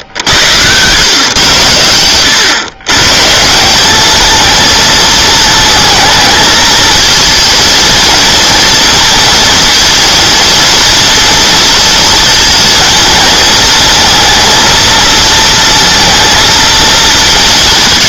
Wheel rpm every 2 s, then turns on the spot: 110, 110, 220, 230, 230, 230, 230, 230, 230.
none